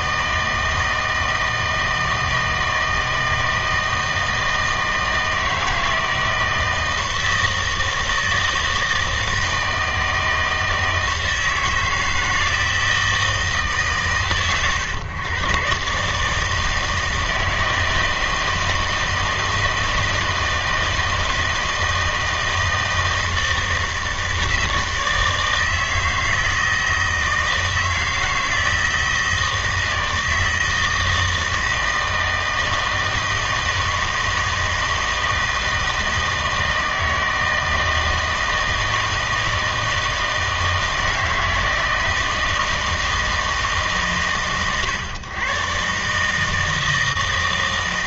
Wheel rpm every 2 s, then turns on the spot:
160, 160, 160, 160, 160, 160, 160, 130, 160, 160, 160, 160, 160, 160, 160, 160, 160, 160, 160, 160, 160, 160, 120, 160.
none